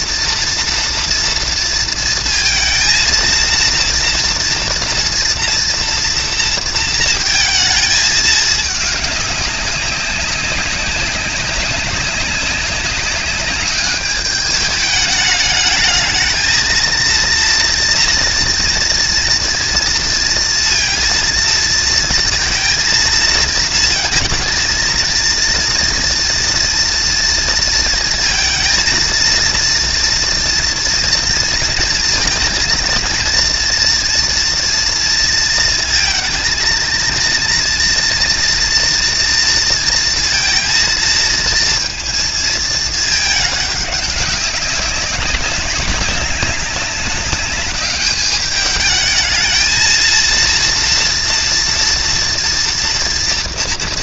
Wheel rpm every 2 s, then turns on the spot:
230, 230, 230, 220, 210, 200, 200, 210, 230, 230, 230, 230, 230, 230, 230, 230, 230, 230, 230, 230, 230, 220, 200, 200, 220, 230, 230.
none